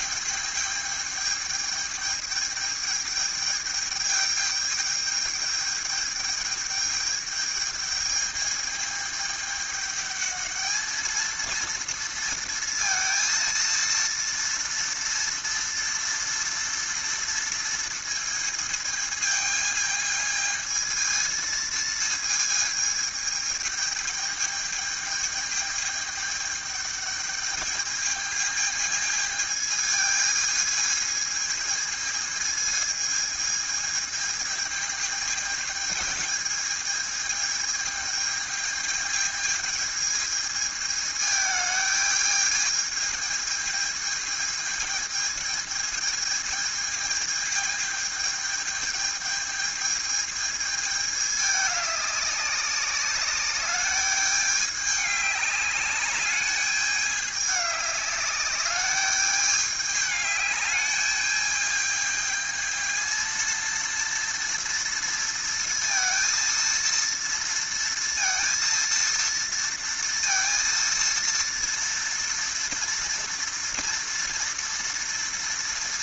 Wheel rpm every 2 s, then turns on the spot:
210, 210, 210, 210, 210, 220, 230, 230, 230, 220, 220, 220, 210, 210, 220, 220, 220, 220, 220, 220, 220, 220, 220, 220, 220, 210, 200, 200, 210, 200, 210, 220, 230, 230, 230, 230, 240, 230.
none